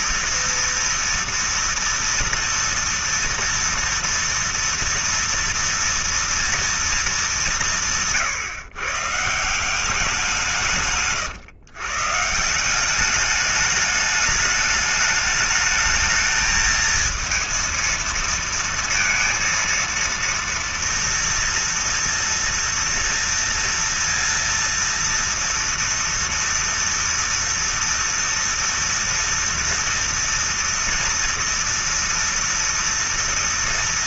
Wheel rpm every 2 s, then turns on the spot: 230, 230, 230, 230, 150, 180, 150, 210, 220, 230, 230, 230, 230, 230, 240, 230, 230.
none